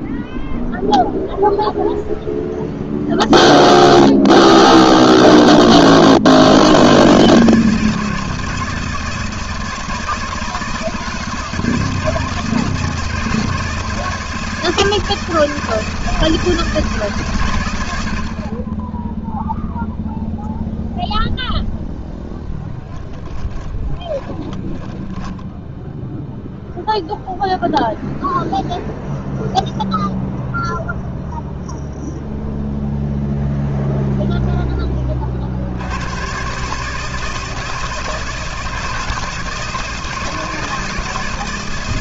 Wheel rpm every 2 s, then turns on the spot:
0, 0, 0, 110, 160, 160, 160, 160, 160, 20, 0, 10, 20, 0, 0, 0, 0, 10, 140, 160, 160.
22-26